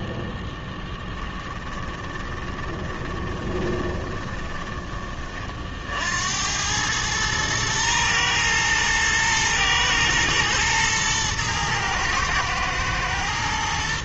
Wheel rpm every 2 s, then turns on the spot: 10, 20, 20, 100, 110, 110, 110.
2-4